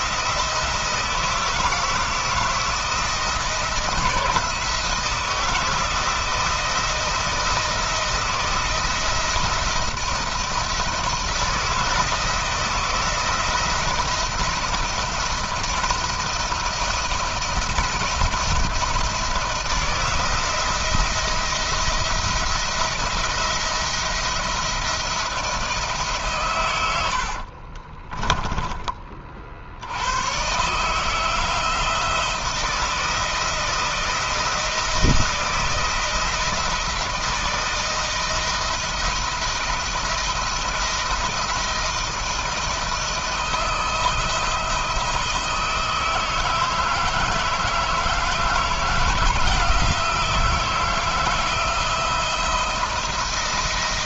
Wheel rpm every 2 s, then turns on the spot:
170, 170, 160, 170, 160, 170, 160, 170, 170, 170, 160, 170, 170, 110, 20, 140, 160, 170, 170, 160, 170, 170, 160, 160, 170, 160, 170.
26-28